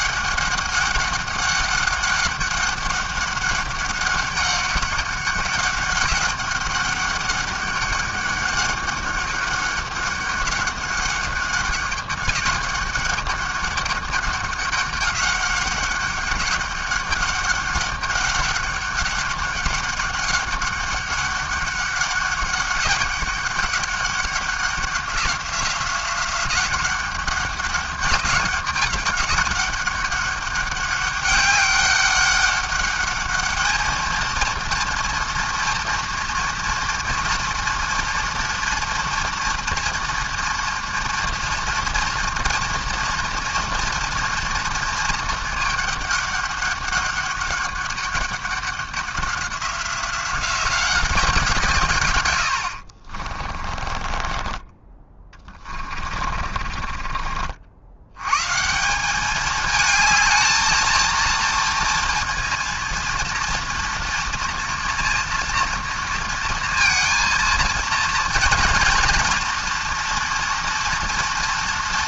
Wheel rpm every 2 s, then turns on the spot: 200, 200, 200, 200, 200, 200, 200, 200, 200, 200, 200, 200, 190, 190, 200, 200, 200, 230, 230, 230, 230, 230, 230, 200, 200, 190, 70, 20, 30, 150, 230, 230, 230, 230, 230, 230.
54-58